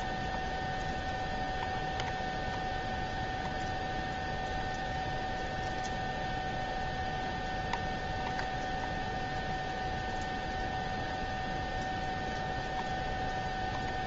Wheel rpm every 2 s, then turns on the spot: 0, 0, 0, 0, 0, 0, 0.
none